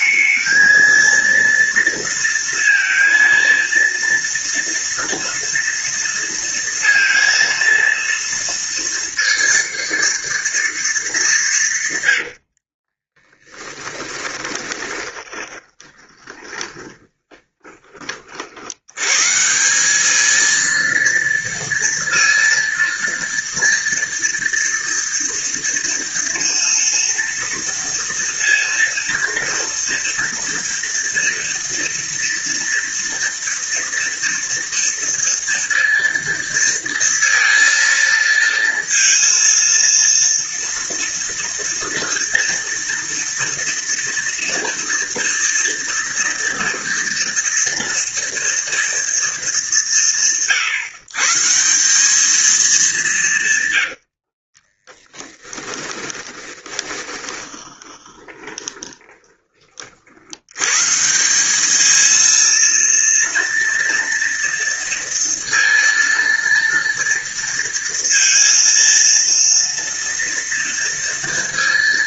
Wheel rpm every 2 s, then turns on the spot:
220, 230, 230, 230, 230, 230, 80, 20, 20, 50, 220, 230, 240, 230, 230, 230, 230, 230, 230, 230, 230, 230, 230, 240, 230, 140, 210, 50, 20, 20, 90, 230, 230, 230, 230, 230.
12-18 54-60